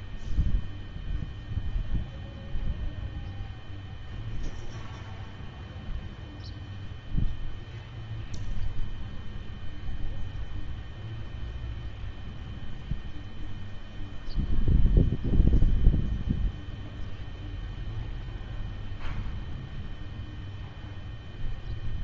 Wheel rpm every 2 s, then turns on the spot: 0, 0, 0, 0, 0, 0, 0, 0, 0, 0, 0.
none